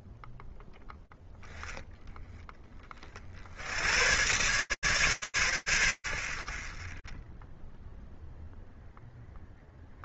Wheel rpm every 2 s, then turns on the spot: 0, 60, 130, 20, 0.
none